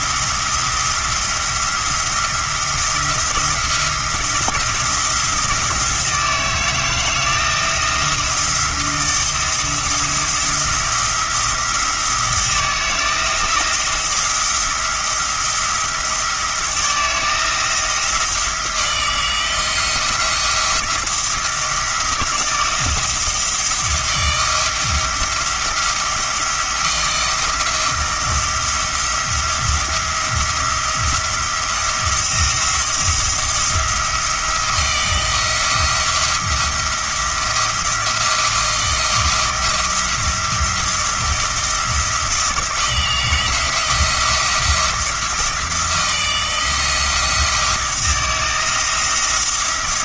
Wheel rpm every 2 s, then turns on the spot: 170, 170, 170, 160, 170, 170, 170, 170, 170, 160, 170, 170, 170, 170, 170, 170, 170, 170, 170, 170, 170, 170, 170, 170, 170.
none